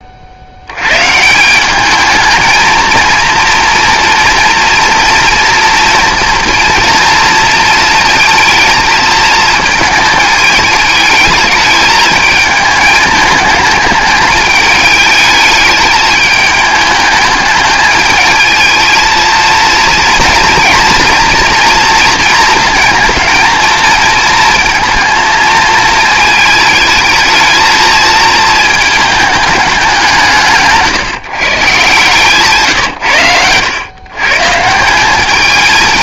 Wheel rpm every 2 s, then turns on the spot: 110, 230, 230, 230, 220, 210, 210, 210, 210, 220, 230, 220, 230, 220, 220, 150, 140, 160.
none